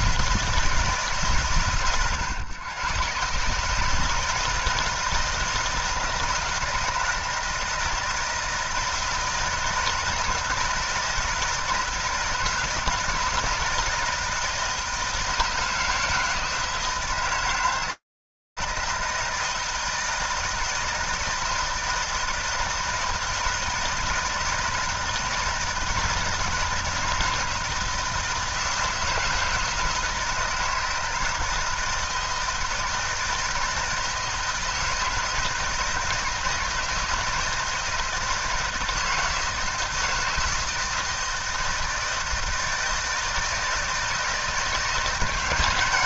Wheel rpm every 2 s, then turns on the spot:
140, 130, 160, 160, 160, 170, 170, 160, 160, 160, 160, 160, 160, 160, 160, 160, 160, 160, 160, 160, 160, 160, 170.
none